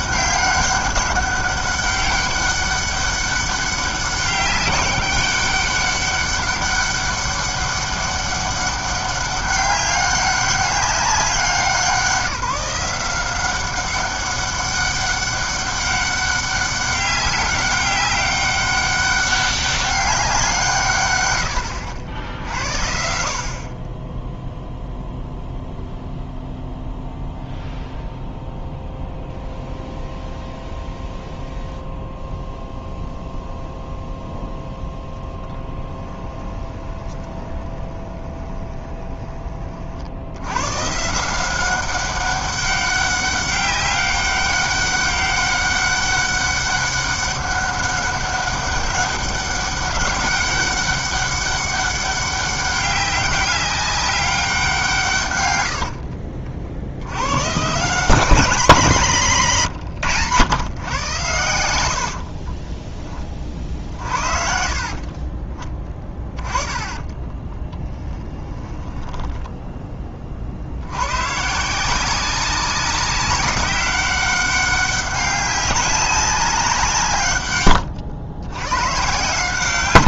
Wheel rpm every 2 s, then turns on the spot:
190, 200, 200, 200, 200, 190, 170, 200, 200, 200, 130, 60, 0, 0, 0, 0, 0, 0, 20, 20, 140, 200, 200, 200, 200, 200, 200, 160, 80, 170, 110, 20, 40, 20, 10, 90, 190, 200, 170, 110.
36-40 64-70